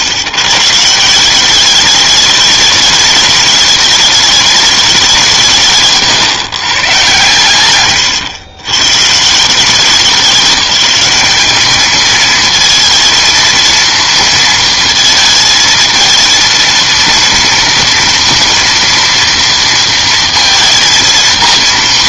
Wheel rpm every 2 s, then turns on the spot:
150, 210, 200, 120, 80, 200, 220, 230, 230, 240, 230.
none